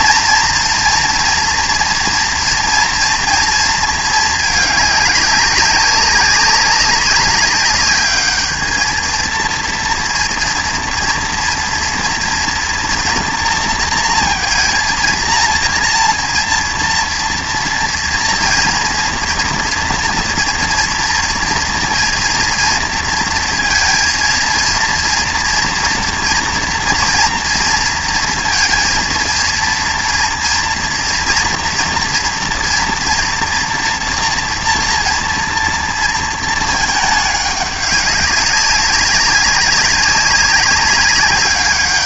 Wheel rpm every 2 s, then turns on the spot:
230, 230, 210, 200, 220, 230, 230, 230, 230, 230, 230, 230, 230, 230, 230, 230, 230, 240, 220, 200, 200.
none